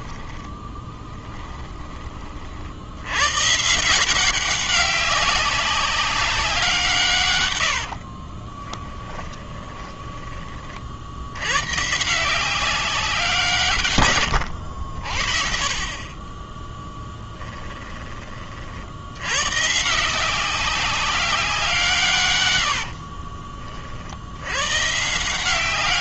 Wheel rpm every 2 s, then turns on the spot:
10, 50, 190, 190, 20, 20, 180, 90, 10, 60, 190, 100, 110.
0-2 8-10